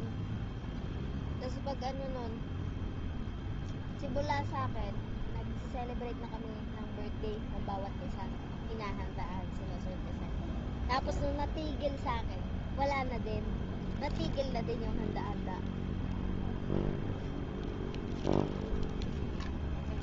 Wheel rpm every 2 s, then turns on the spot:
0, 0, 0, 0, 0, 0, 0, 0, 0, 0.
none